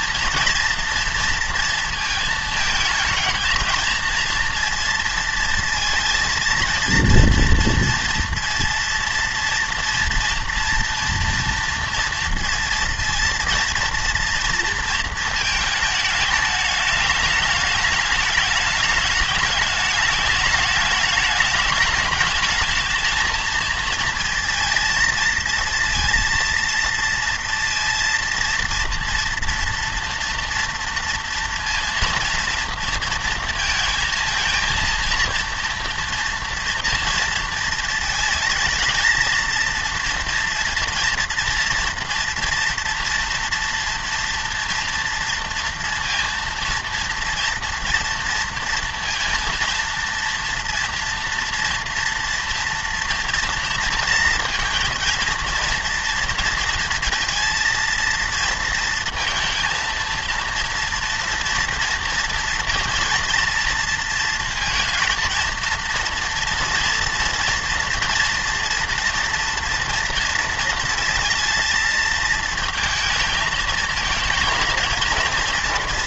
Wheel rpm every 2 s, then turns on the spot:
230, 220, 230, 230, 230, 230, 230, 230, 210, 210, 210, 220, 230, 230, 230, 230, 230, 230, 230, 220, 230, 230, 230, 230, 230, 230, 230, 230, 230, 230, 230, 230, 230, 230, 240, 230, 220, 230.
none